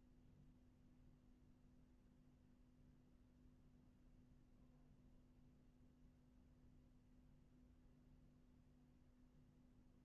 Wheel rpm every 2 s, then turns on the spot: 0, 0, 0, 0, 0.
none